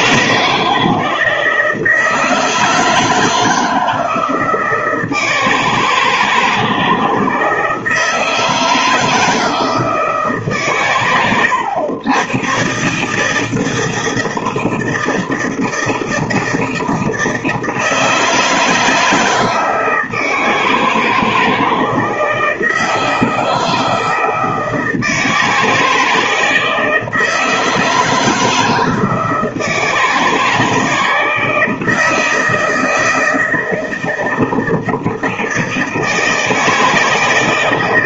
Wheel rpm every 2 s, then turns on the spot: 160, 160, 160, 160, 160, 140, 130, 160, 160, 160, 160, 160, 160, 160, 160, 160, 160, 160, 160.
none